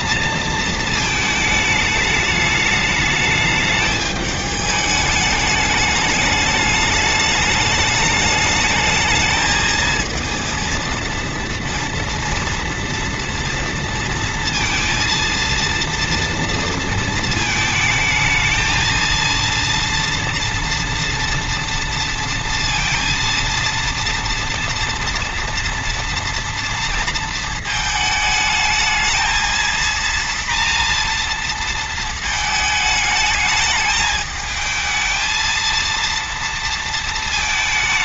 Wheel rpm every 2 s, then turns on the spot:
230, 210, 210, 210, 220, 230, 230, 230, 230, 220, 230, 230, 230, 230, 220, 230, 220, 220, 230.
none